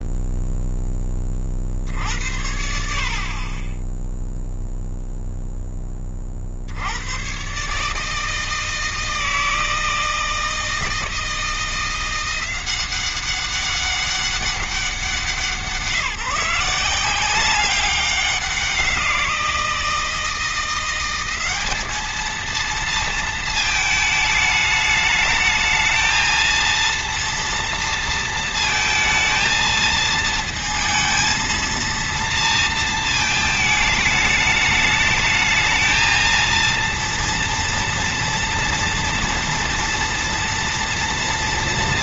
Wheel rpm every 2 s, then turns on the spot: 0, 70, 0, 60, 160, 160, 180, 190, 170, 190, 170, 220, 220, 230, 230, 230, 230, 210, 230, 230, 230.
none